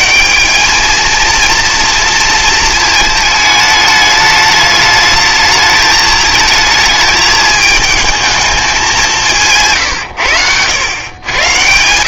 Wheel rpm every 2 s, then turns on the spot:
90, 230, 210, 220, 210, 120.
none